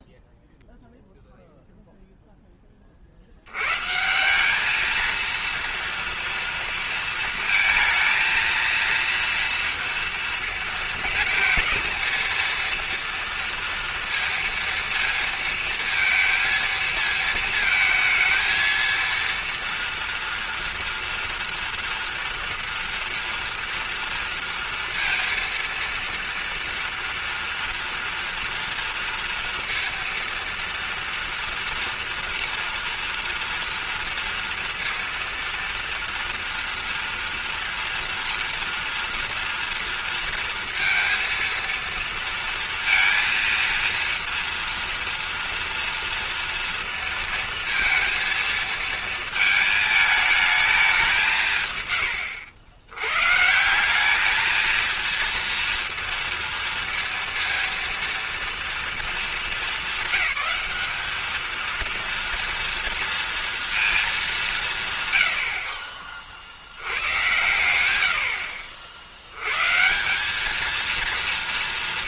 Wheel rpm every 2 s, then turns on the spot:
0, 40, 220, 230, 230, 230, 230, 230, 220, 230, 230, 230, 230, 240, 230, 230, 230, 230, 230, 230, 230, 230, 230, 230, 230, 210, 100, 230, 230, 220, 200, 230, 150, 80, 70, 230.
none